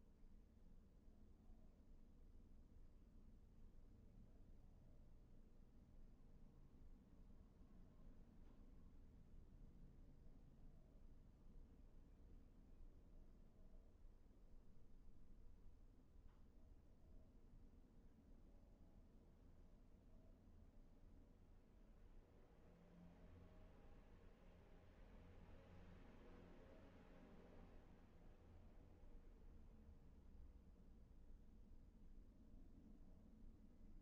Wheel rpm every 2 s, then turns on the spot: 0, 0, 0, 0, 0, 0, 0, 0, 0, 0, 0, 0, 0, 0, 0, 0, 0.
none